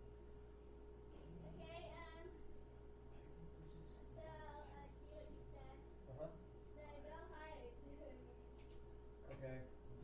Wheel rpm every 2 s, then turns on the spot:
0, 0, 0, 0, 0.
none